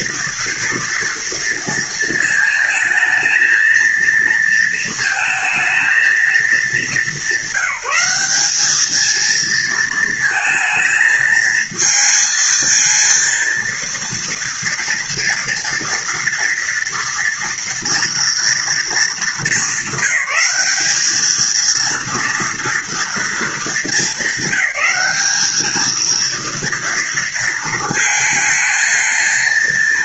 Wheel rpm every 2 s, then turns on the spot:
230, 220, 230, 220, 210, 220, 230, 230, 230, 220, 200, 230, 210, 230, 220.
none